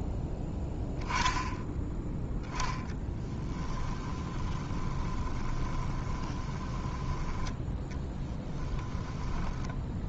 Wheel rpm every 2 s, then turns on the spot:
10, 20, 20, 20, 10.
2-10